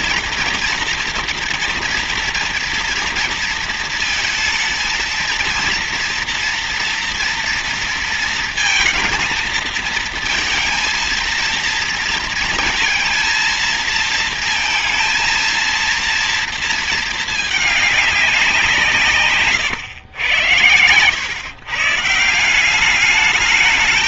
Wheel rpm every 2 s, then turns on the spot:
230, 230, 230, 230, 230, 230, 230, 230, 220, 160, 110, 200.
none